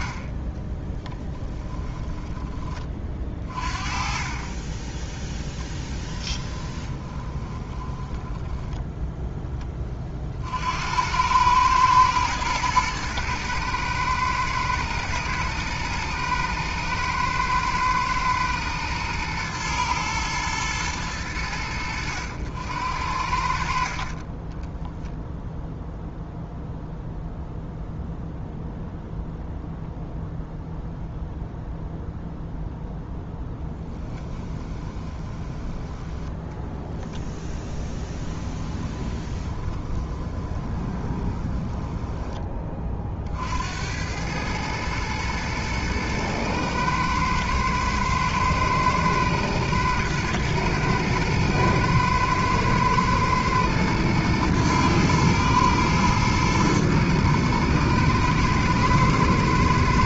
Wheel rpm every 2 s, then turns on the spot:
20, 20, 10, 20, 10, 70, 110, 120, 120, 110, 110, 80, 10, 0, 0, 0, 0, 20, 10, 10, 20, 30, 110, 110, 110, 110, 110, 110, 110, 110.
6-10 24-26 34-36 38-42